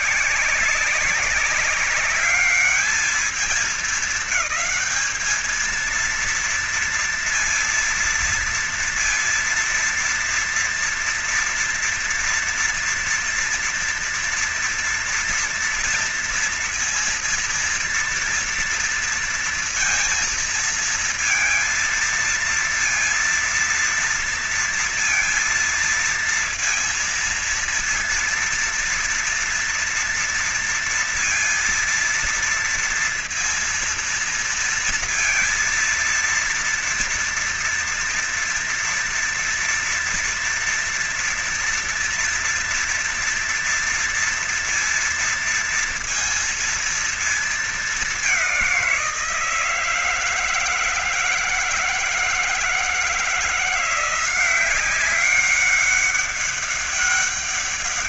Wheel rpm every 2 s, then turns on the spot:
170, 200, 210, 230, 230, 230, 230, 230, 230, 230, 230, 230, 230, 230, 230, 230, 230, 230, 230, 230, 240, 230, 230, 230, 200, 160, 160, 180, 200.
none